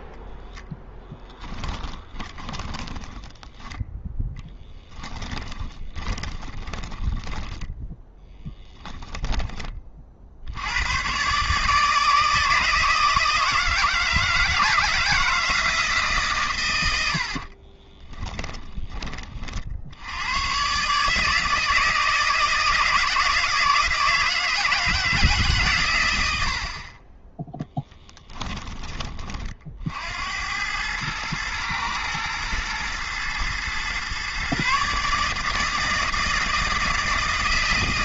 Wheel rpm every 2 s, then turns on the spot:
0, 20, 10, 20, 10, 90, 160, 160, 110, 10, 130, 160, 160, 60, 10, 100, 110, 140, 160.
2-10